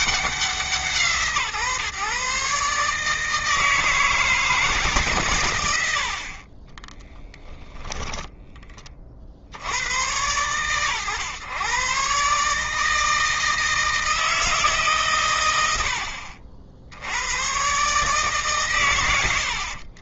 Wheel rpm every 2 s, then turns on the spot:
160, 150, 140, 20, 20, 110, 160, 130, 60, 110.
6-8